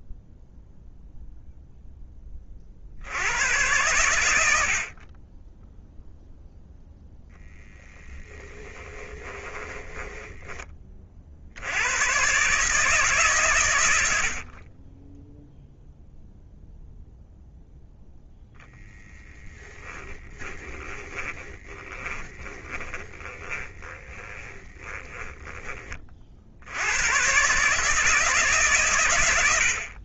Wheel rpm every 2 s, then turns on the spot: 0, 90, 20, 0, 20, 50, 140, 0, 0, 10, 30, 30, 10, 100, 110.
8-10 18-26